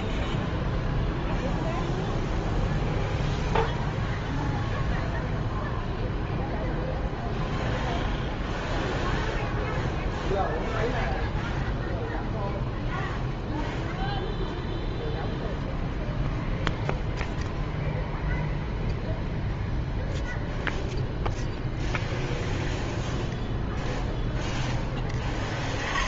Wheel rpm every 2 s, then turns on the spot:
0, 0, 0, 0, 0, 0, 0, 0, 0, 0, 0, 0, 0.
none